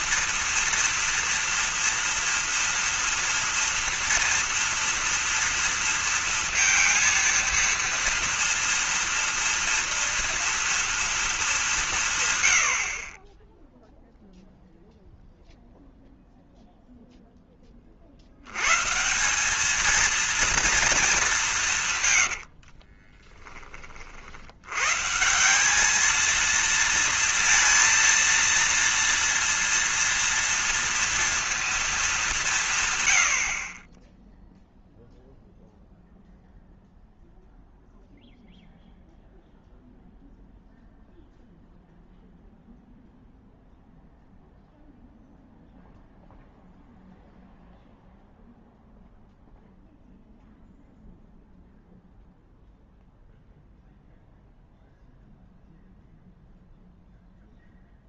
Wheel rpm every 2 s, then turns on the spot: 230, 230, 230, 230, 230, 230, 70, 0, 0, 150, 220, 50, 120, 230, 230, 230, 140, 0, 0, 0, 0, 0, 0, 0, 0, 0, 0, 0, 0.
22-24